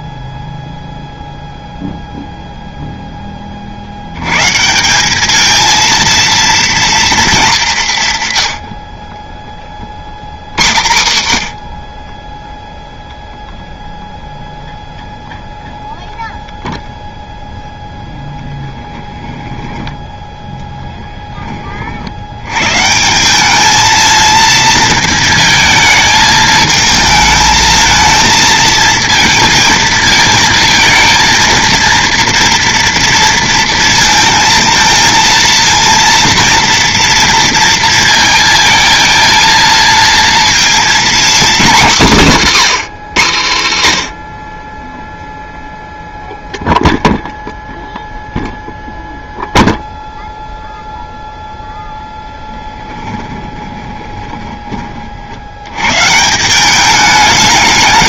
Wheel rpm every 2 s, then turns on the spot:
0, 0, 180, 230, 60, 110, 0, 0, 0, 10, 10, 150, 230, 220, 230, 230, 230, 230, 230, 230, 240, 210, 20, 0, 0, 0, 10, 30, 200.
18-20 52-54